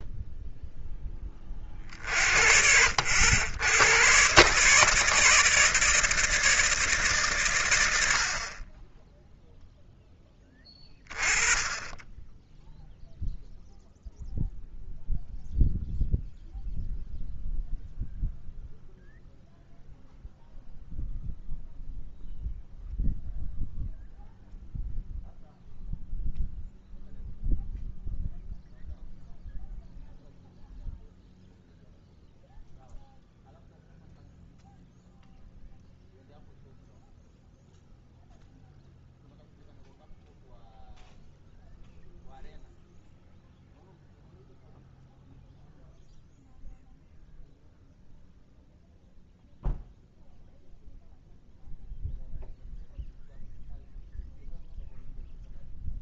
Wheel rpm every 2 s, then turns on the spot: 10, 70, 150, 150, 20, 20, 0, 0, 0, 0, 0, 0, 0, 0, 0, 0, 0, 0, 0, 0, 0, 0, 0, 0, 0, 0, 0, 0.
none